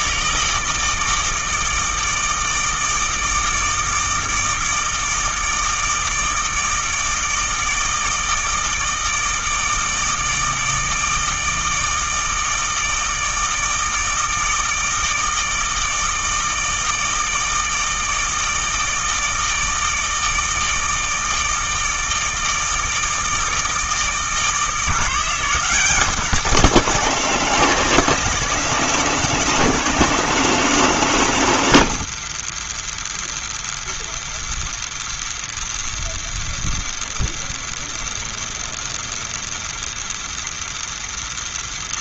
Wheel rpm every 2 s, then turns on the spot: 160, 160, 160, 160, 160, 160, 160, 160, 160, 160, 160, 160, 160, 200, 200, 200, 130, 120, 120, 120, 120.
none